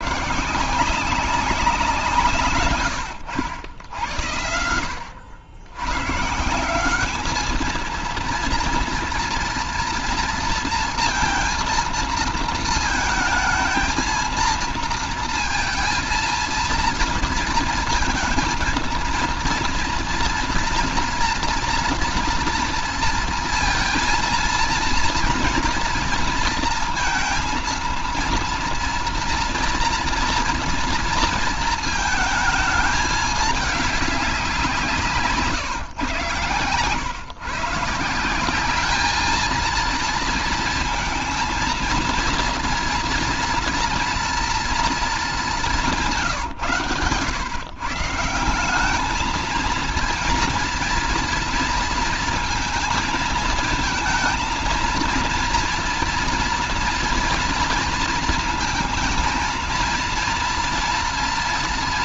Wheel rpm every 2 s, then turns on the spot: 180, 110, 80, 190, 230, 230, 220, 230, 230, 230, 230, 230, 230, 230, 230, 230, 220, 180, 120, 200, 230, 230, 230, 130, 190, 230, 230, 230, 230, 230, 230.
none